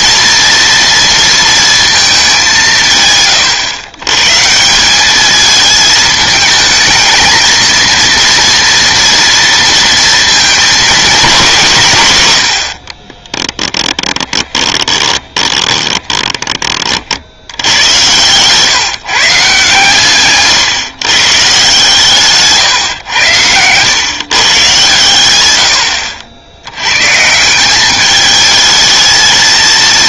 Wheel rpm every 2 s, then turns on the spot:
230, 150, 170, 220, 230, 220, 50, 20, 30, 140, 140, 130, 130, 90, 220.
12-16